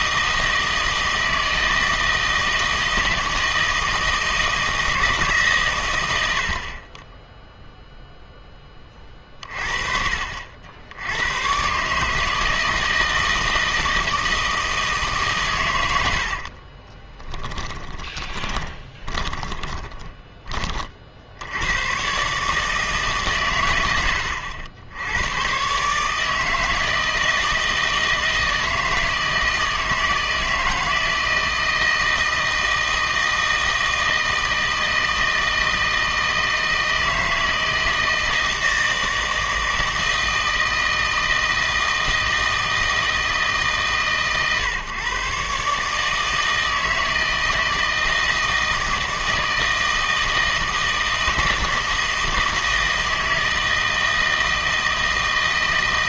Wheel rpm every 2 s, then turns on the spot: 160, 160, 160, 50, 20, 70, 160, 160, 40, 20, 30, 150, 80, 160, 160, 160, 160, 160, 160, 160, 160, 160, 140, 160, 160, 160, 160, 160.
16-20